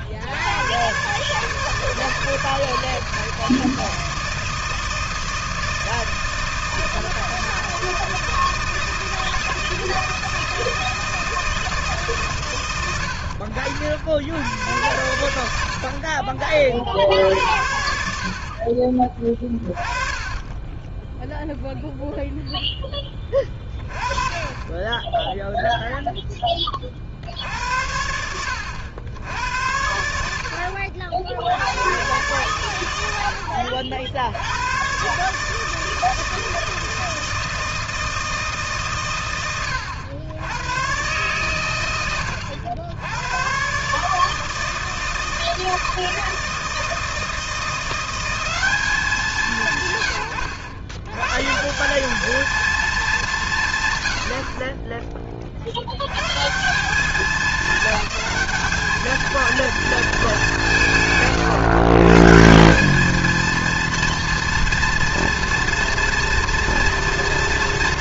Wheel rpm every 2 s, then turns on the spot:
120, 160, 160, 160, 160, 160, 100, 100, 60, 30, 20, 0, 20, 10, 80, 80, 120, 100, 160, 160, 90, 90, 160, 160, 190, 100, 220, 40, 170, 210, 190, 170, 230, 230.
none